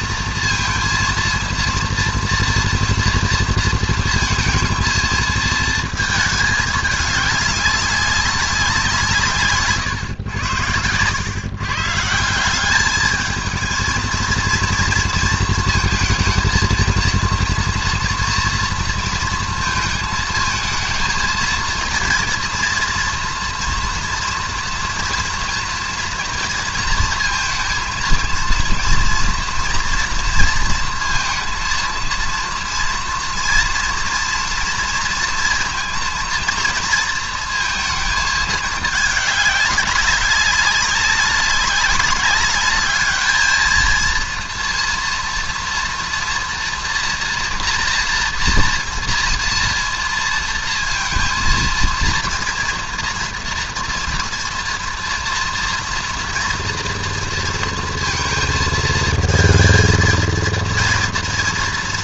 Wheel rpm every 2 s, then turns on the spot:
230, 230, 230, 220, 200, 100, 180, 230, 230, 230, 220, 240, 230, 230, 230, 230, 230, 230, 230, 220, 200, 200, 230, 240, 240, 230, 230, 230, 230, 220, 230.
none